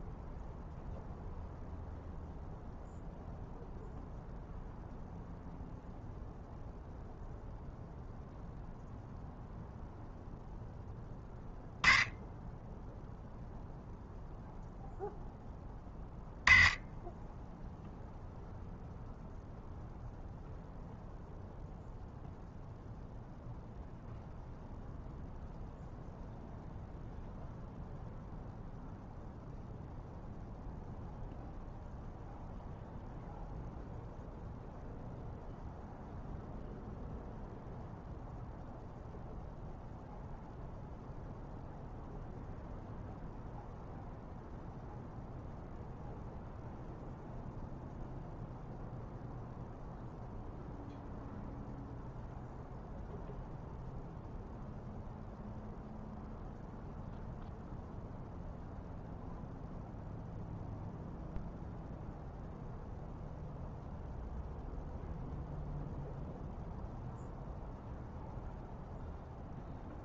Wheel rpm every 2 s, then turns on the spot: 0, 0, 0, 0, 0, 0, 0, 0, 10, 0, 0, 0, 0, 0, 0, 0, 0, 0, 0, 0, 0, 0, 0, 0, 0, 0, 0, 0, 0, 0, 0, 0, 0, 0, 0.
none